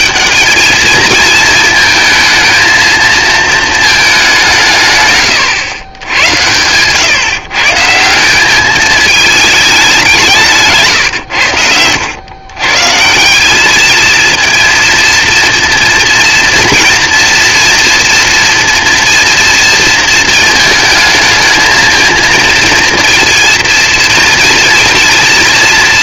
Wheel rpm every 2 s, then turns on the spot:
210, 230, 160, 110, 210, 150, 140, 230, 230, 230, 220, 230, 230.
none